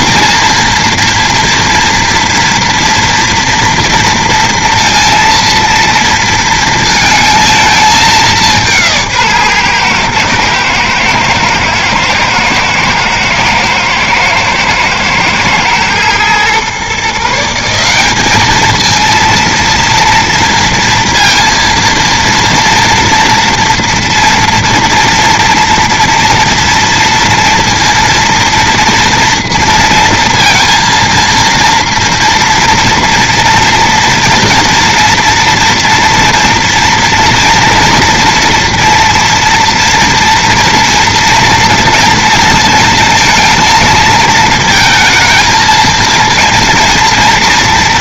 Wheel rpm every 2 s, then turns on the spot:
230, 230, 230, 230, 180, 110, 110, 120, 120, 210, 230, 230, 230, 230, 240, 230, 230, 230, 230, 230, 230, 230, 220, 230.
none